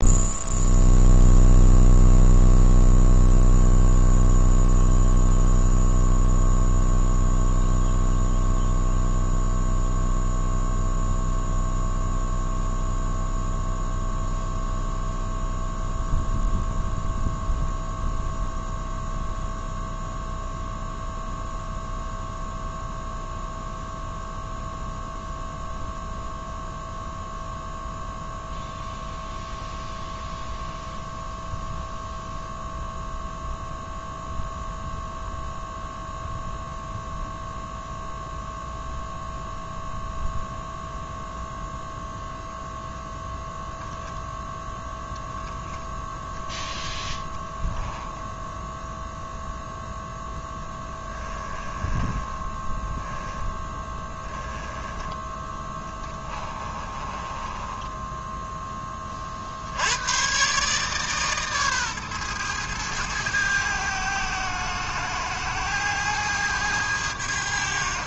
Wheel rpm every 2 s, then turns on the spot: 0, 0, 0, 0, 0, 0, 0, 0, 0, 0, 0, 0, 0, 0, 0, 0, 0, 0, 0, 0, 0, 10, 0, 10, 0, 10, 10, 10, 30, 20, 140, 110, 110, 90.
46-48 50-54 56-58